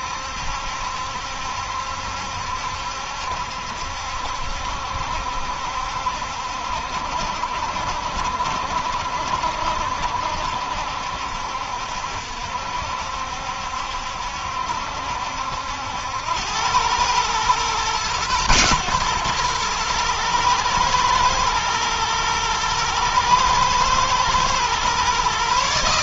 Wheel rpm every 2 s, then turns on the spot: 70, 70, 70, 60, 70, 70, 60, 70, 110, 120, 120, 110, 130.
none